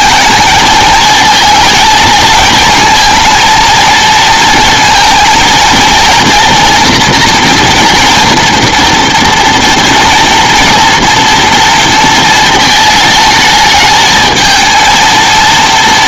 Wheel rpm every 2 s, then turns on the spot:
220, 220, 230, 240, 230, 230, 220, 220.
none